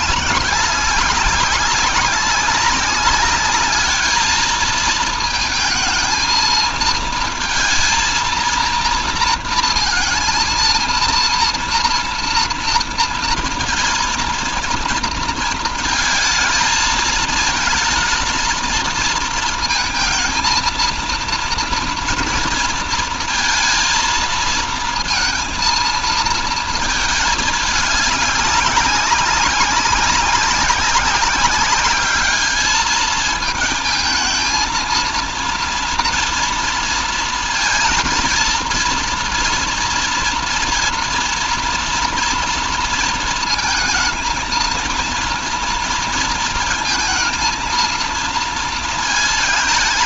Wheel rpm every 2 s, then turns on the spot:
200, 200, 220, 230, 230, 230, 230, 230, 220, 220, 230, 230, 230, 220, 200, 190, 210, 230, 230, 230, 230, 230, 220, 230, 230.
none